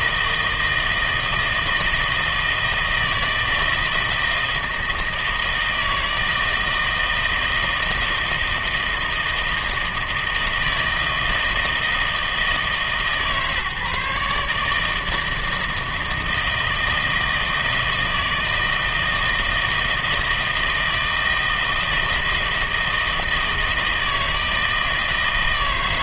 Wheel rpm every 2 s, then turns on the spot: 160, 160, 160, 160, 160, 160, 150, 150, 160, 160, 160, 160, 160.
none